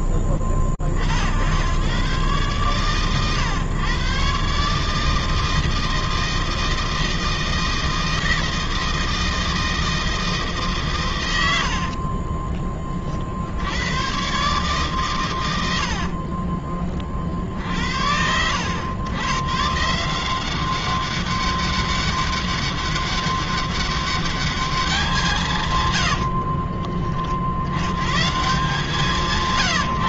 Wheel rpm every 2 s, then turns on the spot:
40, 130, 150, 160, 160, 130, 40, 130, 40, 100, 200, 200, 180, 60, 160.
none